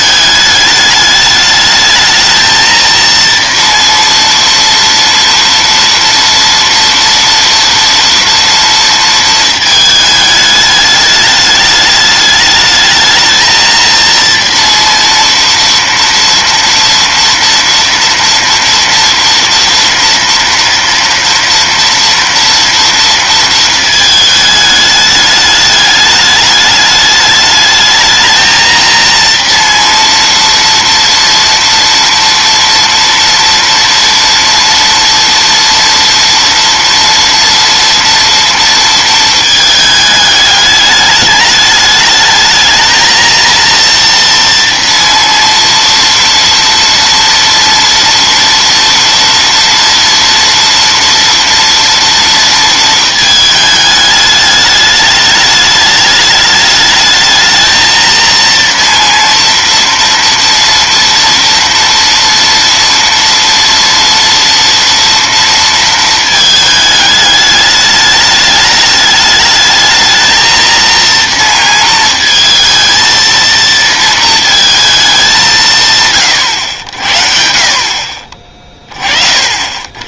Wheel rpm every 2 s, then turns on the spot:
210, 230, 230, 230, 230, 210, 210, 230, 230, 230, 230, 230, 210, 210, 230, 230, 230, 230, 230, 230, 210, 220, 230, 230, 230, 230, 230, 210, 210, 230, 230, 240, 230, 220, 210, 230, 230, 220, 90, 30.
none